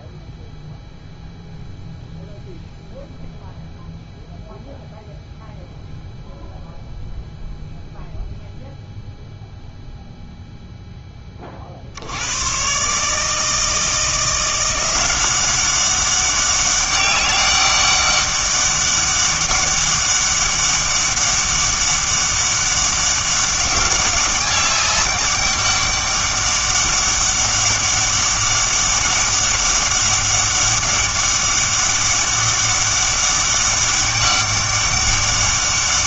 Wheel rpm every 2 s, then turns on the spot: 0, 0, 0, 0, 0, 0, 130, 180, 200, 200, 200, 200, 200, 200, 200, 200, 200, 200.
none